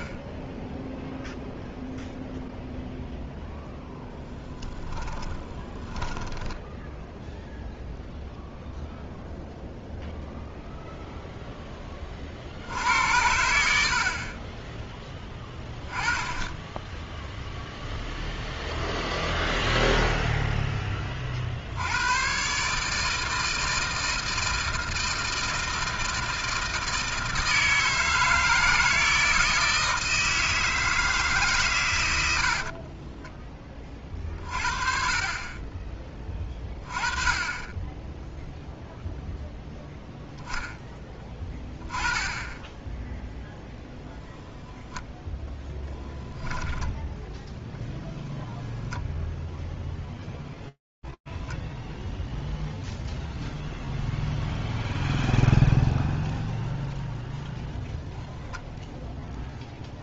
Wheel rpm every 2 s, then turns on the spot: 0, 20, 0, 0, 0, 70, 10, 10, 0, 0, 130, 160, 160, 160, 160, 100, 30, 20, 10, 0, 10, 0, 10, 0, 0, 0, 0, 0, 0, 20.
2-4 44-46